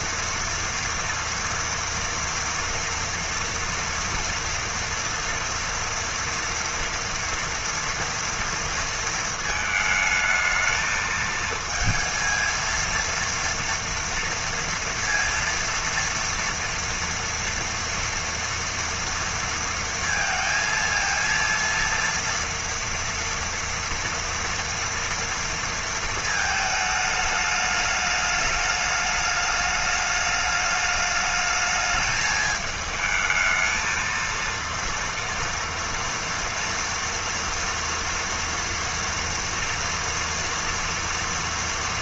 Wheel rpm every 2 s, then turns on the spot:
230, 240, 230, 230, 230, 220, 230, 230, 230, 230, 230, 230, 230, 210, 210, 210, 220, 230, 230, 230, 240.
none